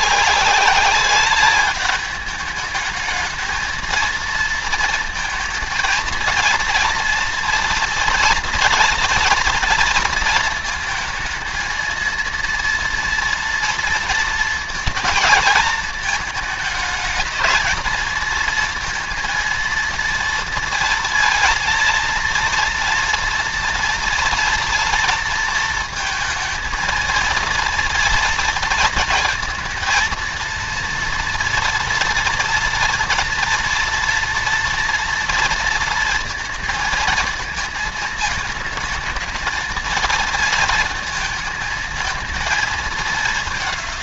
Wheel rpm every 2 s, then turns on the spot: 200, 220, 230, 230, 230, 230, 230, 230, 220, 230, 230, 230, 230, 230, 230, 230, 230, 230, 220, 220, 220, 210.
none